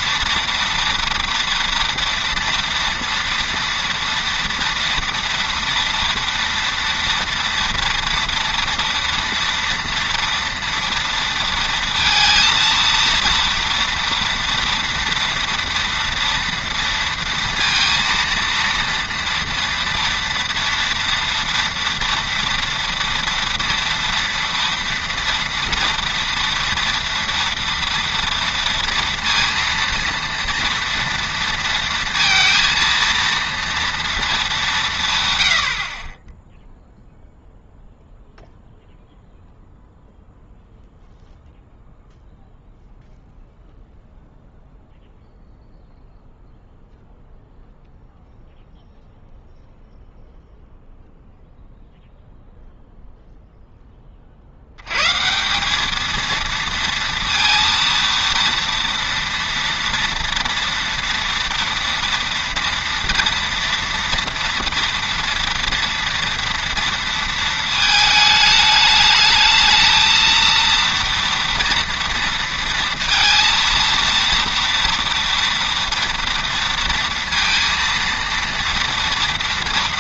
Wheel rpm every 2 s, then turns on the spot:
240, 230, 240, 240, 230, 230, 230, 230, 230, 230, 230, 230, 230, 230, 230, 230, 230, 190, 0, 0, 0, 0, 0, 0, 0, 0, 0, 70, 230, 230, 240, 230, 230, 230, 210, 220, 230, 240, 230, 230.
none